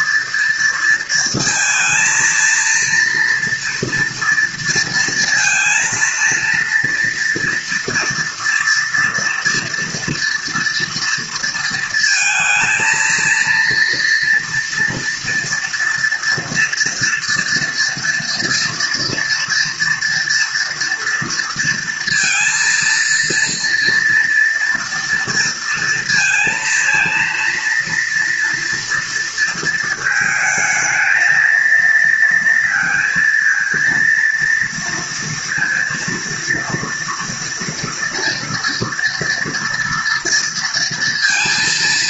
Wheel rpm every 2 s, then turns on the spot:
230, 230, 230, 230, 230, 230, 230, 230, 230, 230, 240, 230, 240, 230, 230, 220, 230, 230, 230, 230, 230.
none